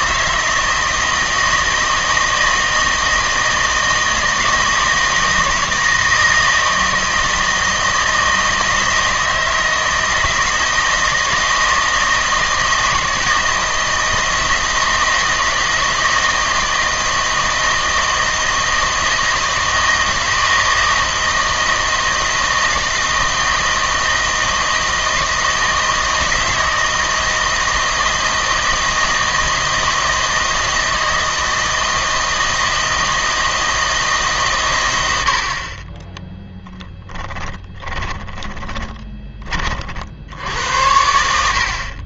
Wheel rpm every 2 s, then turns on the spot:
160, 160, 160, 160, 160, 160, 160, 160, 160, 160, 160, 160, 160, 160, 160, 160, 160, 120, 10, 20, 80.
38-40